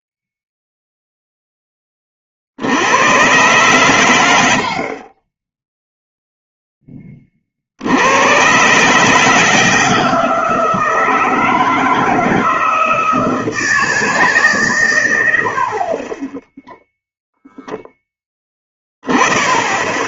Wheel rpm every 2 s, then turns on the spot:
0, 80, 70, 10, 130, 160, 160, 130, 0, 20.
none